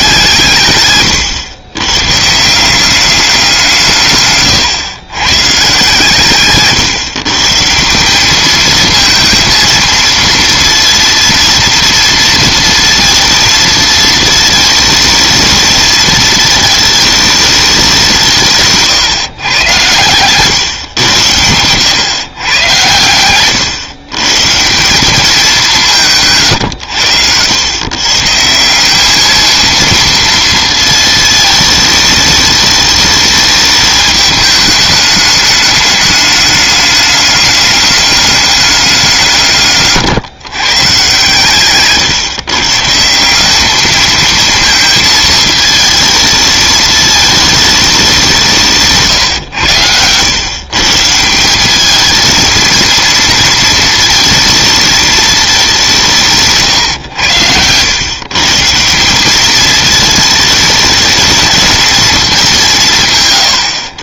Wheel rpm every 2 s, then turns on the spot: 140, 170, 130, 140, 220, 230, 230, 220, 220, 150, 130, 120, 150, 130, 180, 230, 220, 210, 210, 200, 140, 140, 220, 220, 160, 140, 220, 220, 140, 150, 220, 180.
4-6